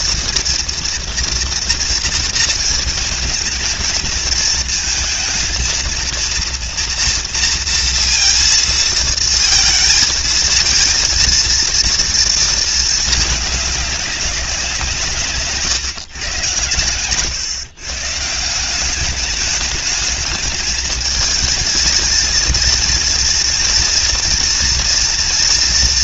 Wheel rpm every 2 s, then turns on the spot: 230, 230, 230, 230, 230, 230, 220, 180, 120, 180, 220, 230, 240.
16-18